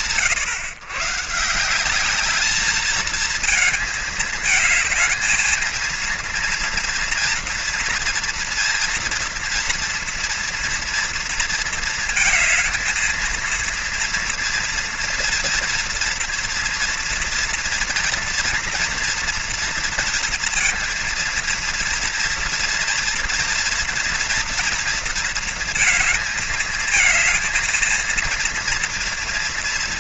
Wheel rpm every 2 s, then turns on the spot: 140, 220, 220, 230, 230, 230, 220, 230, 230, 230, 230, 230, 230, 220, 230.
none